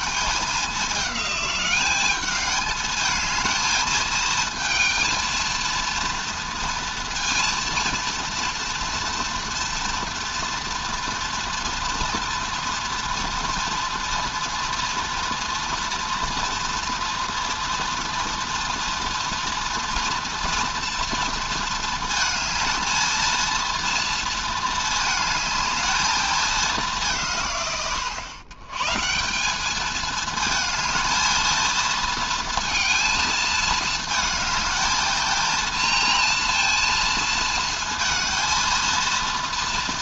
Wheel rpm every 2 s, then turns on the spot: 200, 210, 220, 230, 230, 230, 240, 230, 230, 240, 230, 220, 220, 200, 120, 220, 220, 220, 230, 230.
none